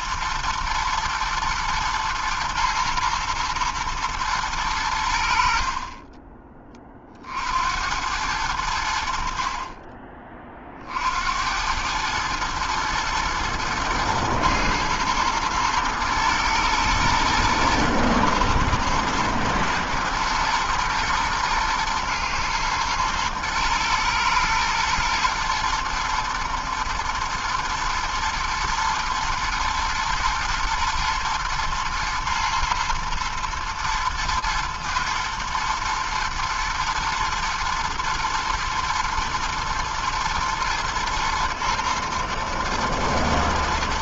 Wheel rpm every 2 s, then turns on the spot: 110, 110, 110, 20, 90, 30, 110, 110, 120, 120, 120, 110, 120, 120, 110, 110, 120, 120, 120, 120, 120, 110.
none